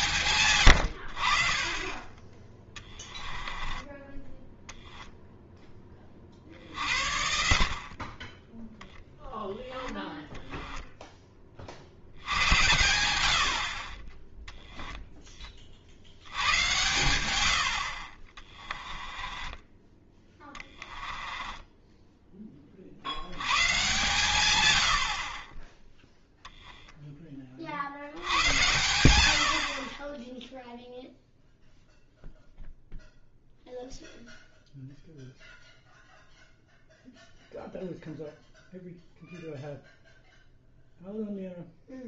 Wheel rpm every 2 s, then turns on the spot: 90, 20, 0, 60, 0, 10, 90, 0, 100, 20, 10, 50, 80, 10, 100, 0, 0, 0, 0, 0, 0.
2-4 18-22 26-28